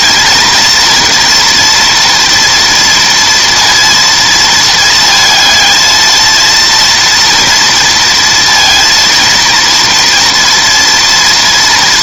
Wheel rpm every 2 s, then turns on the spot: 230, 240, 220, 230, 230, 230.
none